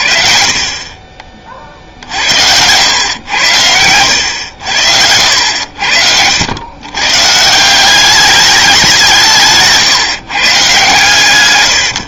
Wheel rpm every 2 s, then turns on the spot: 40, 90, 90, 90, 200, 130.
none